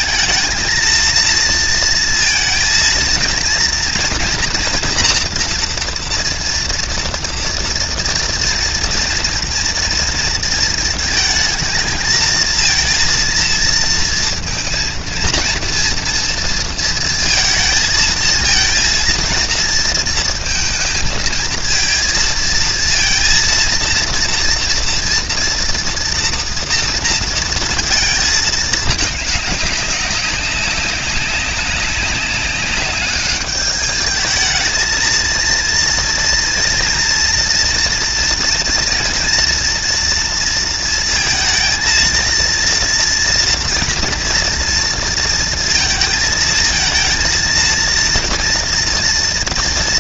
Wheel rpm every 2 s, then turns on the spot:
230, 230, 240, 230, 230, 230, 230, 230, 230, 230, 230, 230, 230, 230, 210, 200, 200, 220, 230, 230, 230, 230, 230, 230, 230.
none